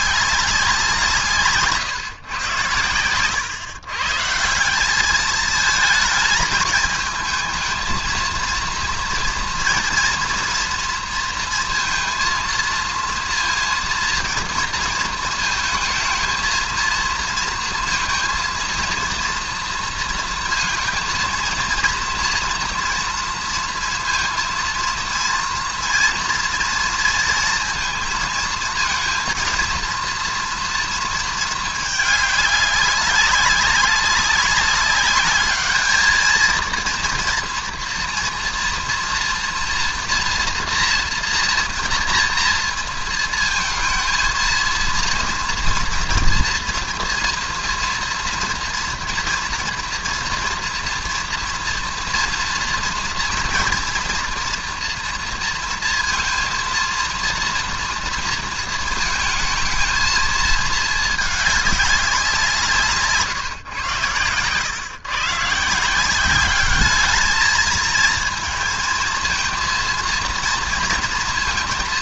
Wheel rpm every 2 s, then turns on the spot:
190, 130, 160, 220, 230, 230, 230, 230, 220, 230, 230, 230, 230, 230, 230, 230, 200, 200, 230, 230, 240, 230, 220, 240, 230, 230, 230, 240, 230, 230, 220, 190, 110, 200, 230, 230.
none